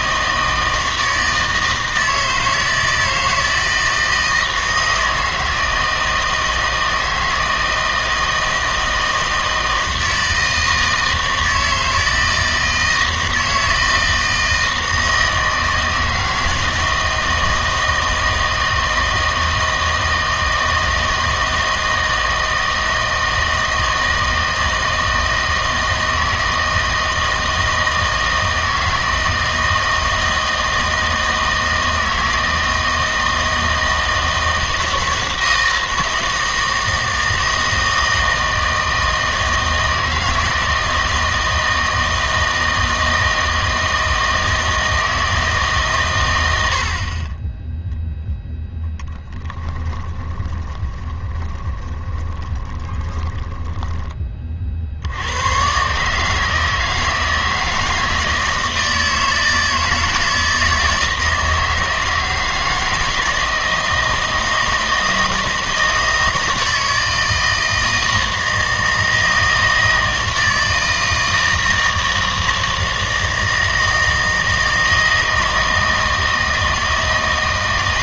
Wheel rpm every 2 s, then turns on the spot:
160, 160, 160, 160, 160, 160, 160, 160, 160, 160, 160, 160, 160, 160, 160, 160, 160, 160, 160, 160, 160, 160, 160, 90, 0, 20, 20, 40, 160, 160, 160, 160, 160, 160, 160, 160, 160, 160, 160.
50-54